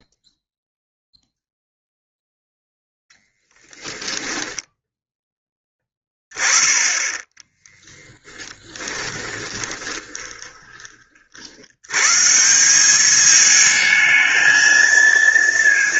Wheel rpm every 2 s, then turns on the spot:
0, 0, 10, 20, 20, 20, 190, 230.
4-6 8-10